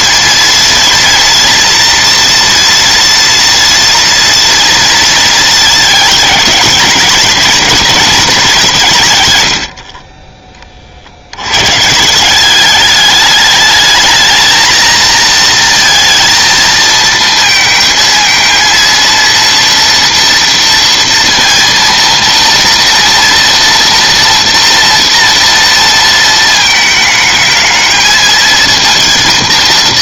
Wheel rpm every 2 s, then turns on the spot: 230, 230, 230, 210, 160, 30, 200, 220, 230, 230, 230, 230, 240, 220, 220.
none